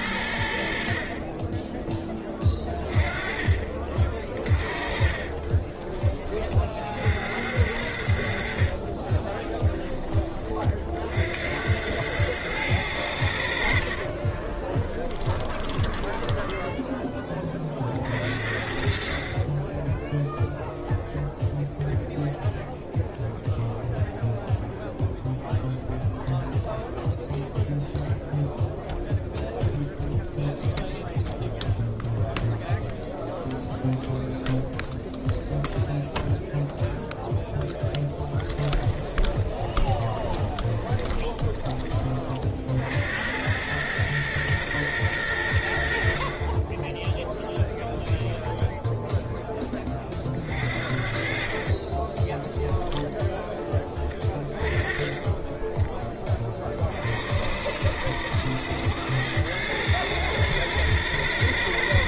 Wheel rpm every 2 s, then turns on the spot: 70, 20, 30, 30, 60, 40, 100, 30, 10, 50, 0, 0, 0, 0, 0, 0, 0, 0, 0, 20, 20, 50, 120, 30, 0, 50, 20, 20, 30, 90, 100.
4-6 14-18 38-42 52-54